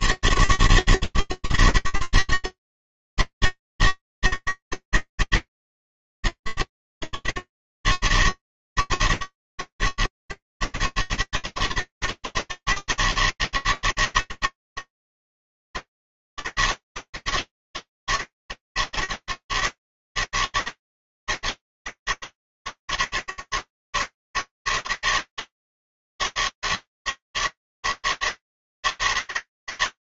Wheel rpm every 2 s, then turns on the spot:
160, 160, 160, 160, 160, 140, 160, 160, 160, 160, 150, 150, 150, 160, 150.
none